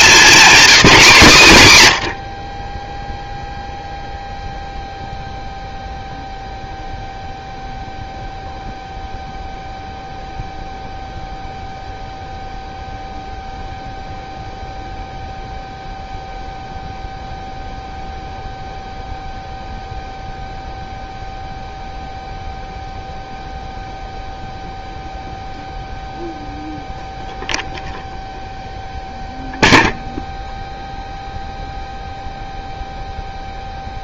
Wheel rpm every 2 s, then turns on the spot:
210, 30, 0, 0, 0, 0, 0, 0, 0, 0, 0, 0, 0, 0, 0, 0, 0.
none